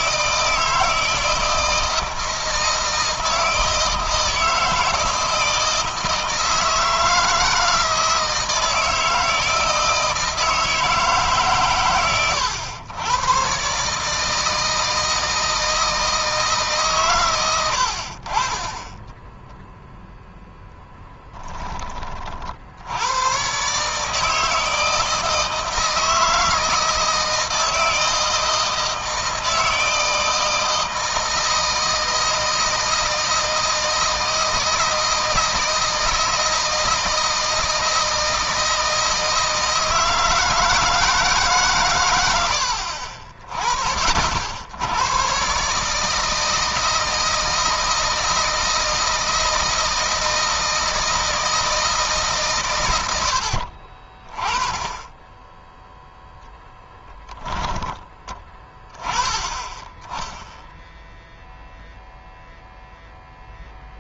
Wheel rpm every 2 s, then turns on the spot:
160, 160, 160, 160, 160, 160, 120, 160, 130, 10, 10, 80, 160, 160, 160, 160, 160, 160, 160, 160, 160, 60, 90, 160, 160, 160, 100, 10, 10, 20, 0, 0.
20-22 56-58